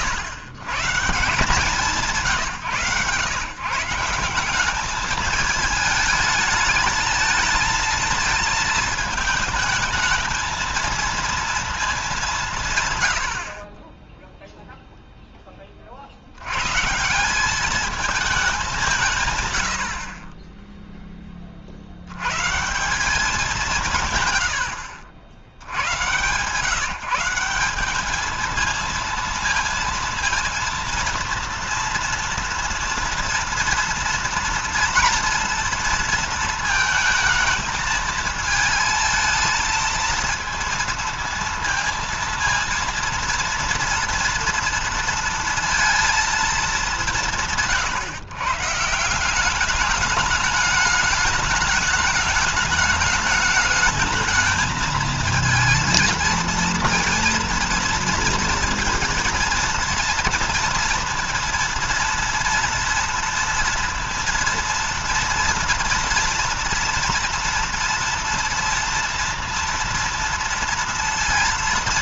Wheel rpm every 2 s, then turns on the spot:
120, 140, 190, 220, 220, 220, 140, 0, 120, 190, 20, 150, 90, 140, 220, 230, 230, 230, 230, 220, 230, 230, 230, 210, 150, 210, 210, 220, 230, 230, 230, 230, 230, 230, 230, 230.
none